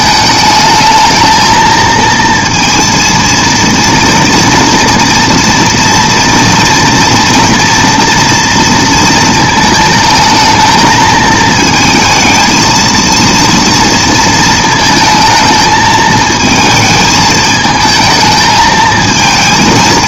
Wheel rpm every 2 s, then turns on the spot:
220, 230, 230, 230, 230, 220, 230, 220, 220, 220.
none